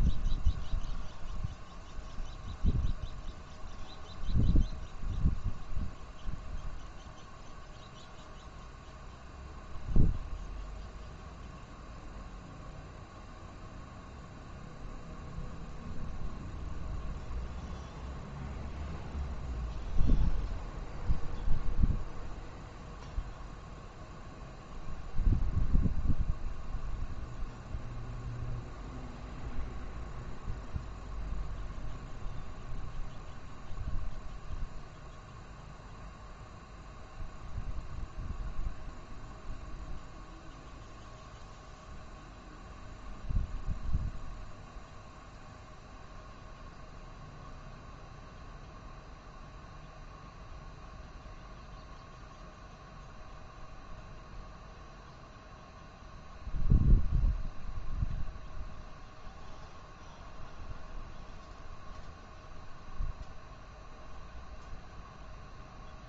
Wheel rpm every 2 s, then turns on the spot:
0, 0, 0, 0, 0, 0, 0, 0, 0, 0, 0, 0, 0, 0, 0, 0, 0, 0, 0, 0, 0, 0, 0, 0, 0, 0, 0, 0, 0, 0, 0, 0, 0.
none